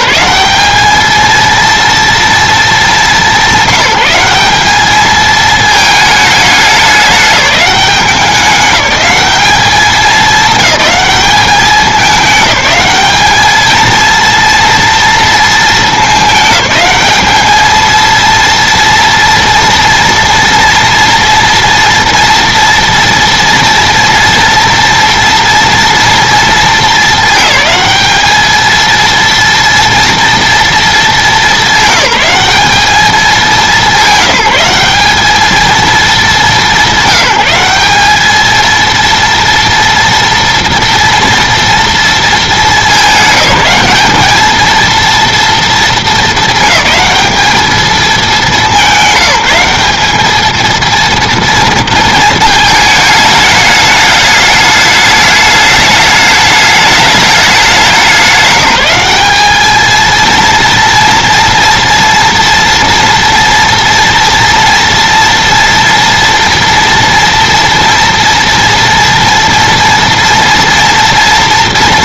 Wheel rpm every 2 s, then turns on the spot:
210, 210, 210, 200, 200, 200, 200, 230, 210, 230, 230, 230, 230, 230, 230, 220, 200, 190, 190, 230, 230, 210, 230, 210, 200, 230, 220, 210, 210, 190, 230, 230, 230, 230, 230, 240.
none